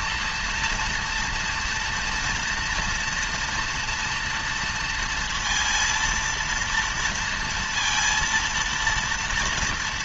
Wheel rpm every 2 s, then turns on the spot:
240, 230, 230, 230, 230.
none